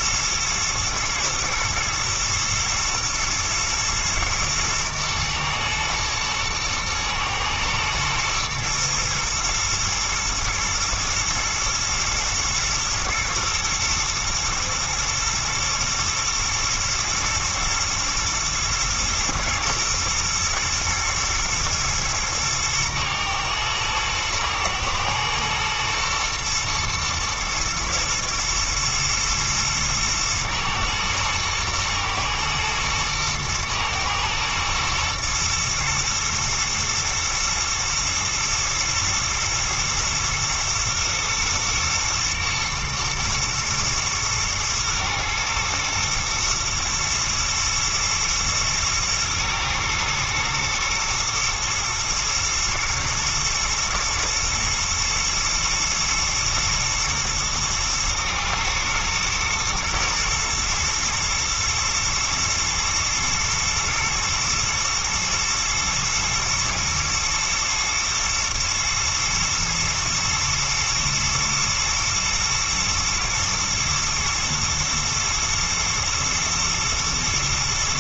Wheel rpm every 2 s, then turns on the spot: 120, 110, 110, 120, 120, 110, 120, 110, 110, 120, 110, 110, 110, 120, 110, 110, 110, 110, 120, 110, 110, 110, 110, 110, 110, 110, 120, 120, 110, 110, 110, 110, 120, 110, 120, 120, 110, 110, 110.
none